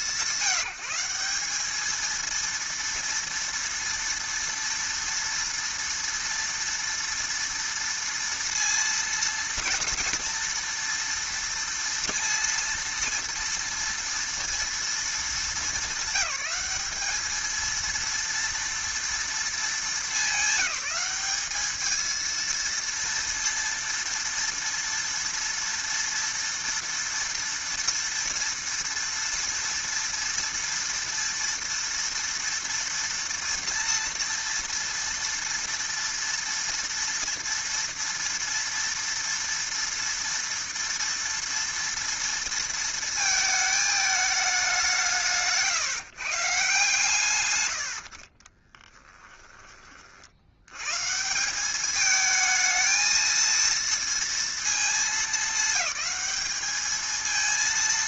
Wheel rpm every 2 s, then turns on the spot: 190, 230, 240, 230, 230, 230, 230, 230, 210, 230, 200, 230, 230, 230, 230, 240, 230, 230, 230, 230, 230, 230, 180, 140, 10, 120, 220, 220, 220.
48-50